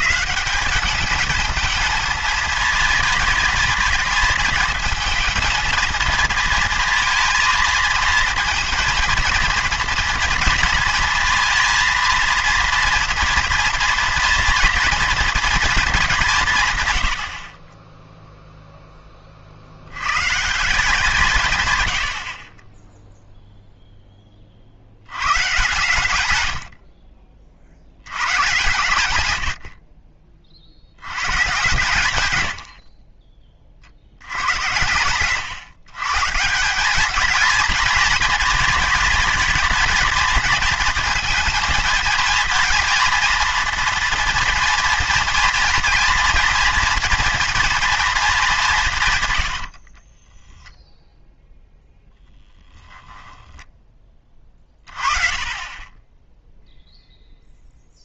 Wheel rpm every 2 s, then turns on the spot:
190, 220, 230, 230, 220, 230, 230, 230, 160, 0, 160, 20, 50, 70, 120, 50, 100, 90, 180, 220, 230, 230, 230, 230, 190, 0, 10, 30, 0.
26-28 52-54